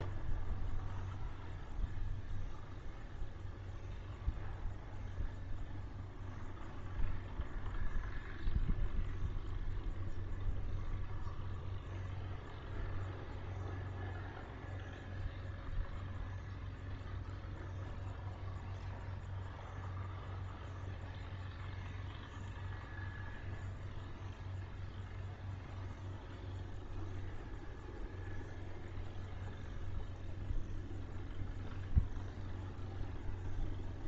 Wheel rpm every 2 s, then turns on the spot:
0, 0, 0, 0, 0, 0, 0, 0, 0, 0, 0, 0, 0, 0, 0, 0, 0.
none